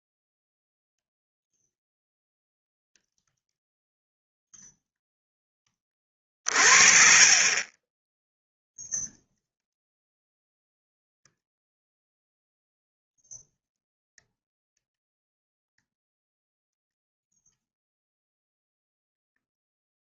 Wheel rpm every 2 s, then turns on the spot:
0, 0, 0, 40, 0, 0, 0, 0, 0, 0.
none